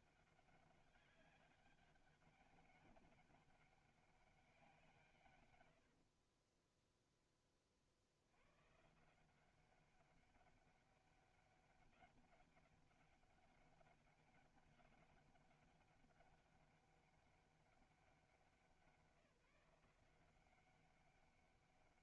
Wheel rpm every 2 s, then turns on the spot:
200, 200, 190, 20, 120, 200, 200, 190, 200, 180, 190.
6-8